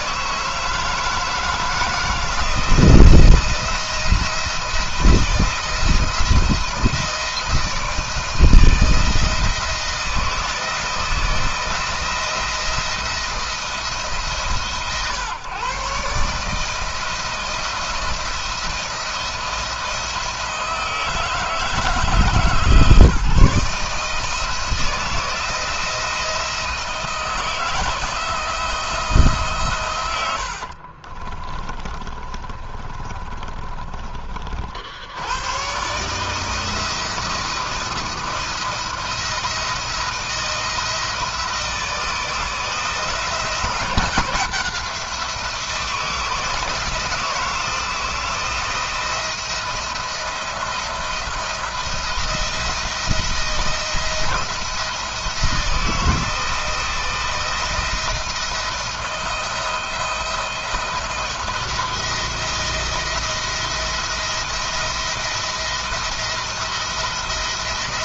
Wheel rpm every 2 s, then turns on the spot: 160, 170, 170, 160, 160, 160, 170, 130, 160, 170, 160, 160, 160, 160, 160, 50, 30, 70, 170, 170, 160, 160, 170, 160, 170, 170, 170, 170, 160, 170, 170, 170, 170, 170.
30-34